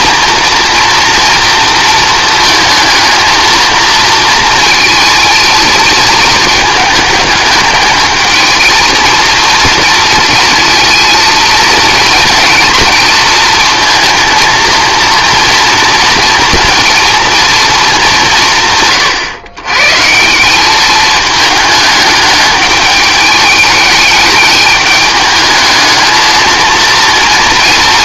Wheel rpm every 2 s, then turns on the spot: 230, 230, 230, 220, 230, 220, 220, 230, 230, 150, 200, 210, 210, 230.
none